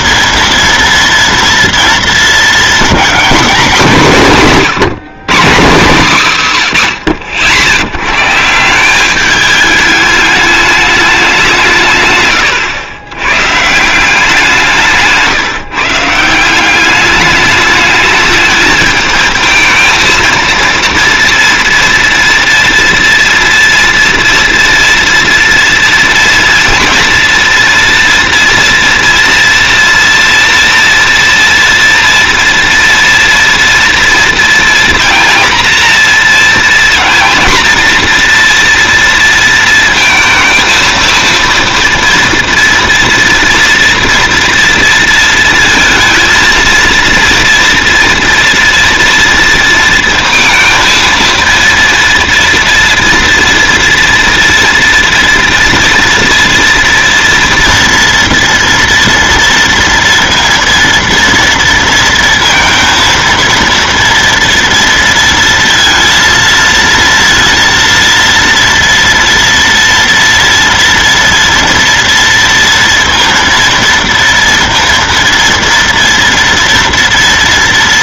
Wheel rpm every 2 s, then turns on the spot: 230, 220, 170, 150, 160, 210, 110, 170, 180, 210, 230, 230, 230, 230, 230, 230, 230, 230, 230, 240, 230, 230, 230, 230, 230, 230, 230, 240, 230, 240, 230, 230, 230, 230, 230, 230, 230, 230, 240.
none